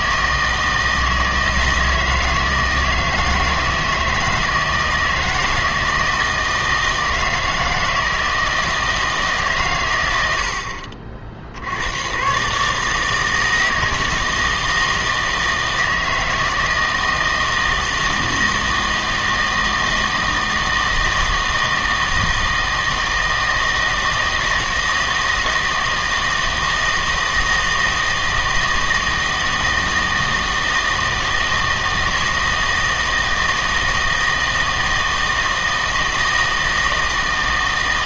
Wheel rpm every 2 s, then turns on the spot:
160, 160, 160, 160, 160, 70, 140, 160, 160, 160, 160, 160, 160, 160, 160, 160, 160, 160, 160.
none